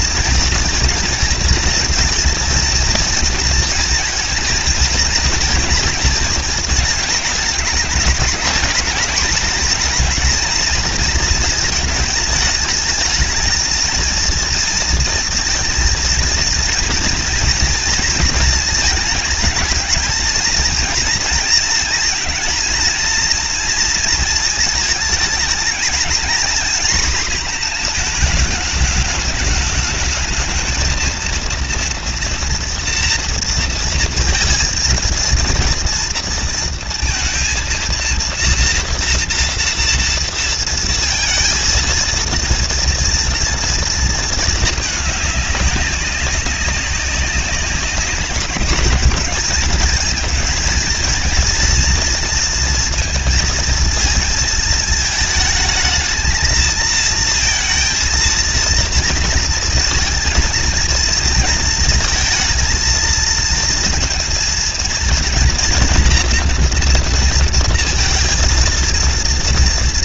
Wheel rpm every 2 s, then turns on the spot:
230, 220, 230, 230, 210, 220, 210, 230, 230, 230, 230, 230, 220, 230, 220, 220, 240, 230, 230, 230, 230, 230, 230, 200, 210, 230, 230, 220, 220, 230, 230, 220, 230, 230, 230.
none